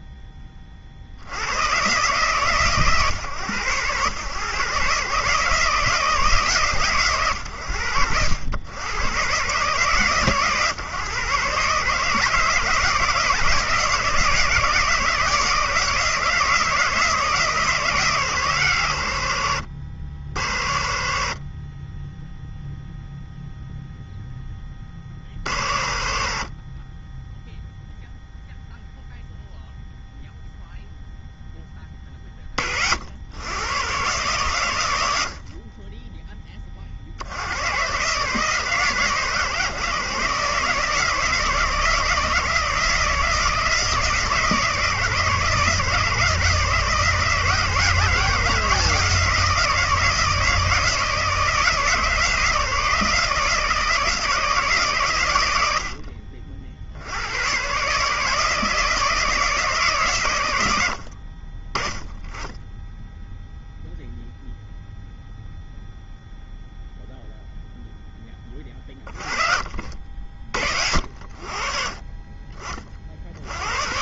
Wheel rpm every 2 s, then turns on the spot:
150, 110, 150, 90, 130, 150, 160, 160, 140, 80, 10, 10, 50, 0, 0, 30, 130, 10, 140, 140, 160, 160, 160, 170, 160, 160, 160, 70, 150, 110, 20, 0, 0, 30, 70, 60, 90.
none